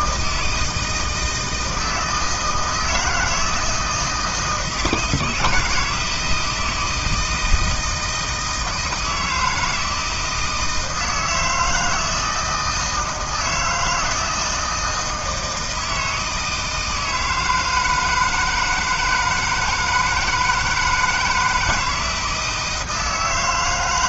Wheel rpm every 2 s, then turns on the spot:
160, 160, 160, 160, 160, 160, 160, 160, 160, 160, 160, 160.
none